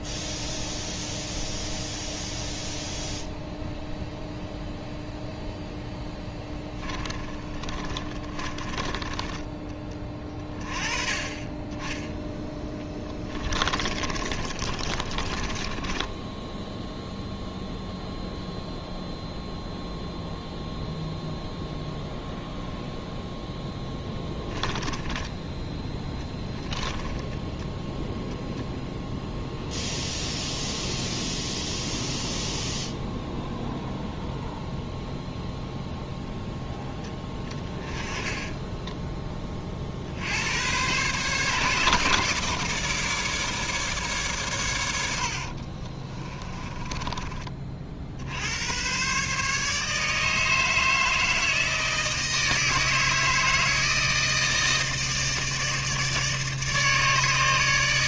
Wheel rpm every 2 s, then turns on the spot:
0, 0, 0, 10, 20, 30, 10, 30, 10, 0, 0, 0, 10, 10, 0, 0, 0, 0, 10, 10, 110, 150, 120, 20, 110, 160, 160, 160, 150.
6-10 12-18 24-26 38-40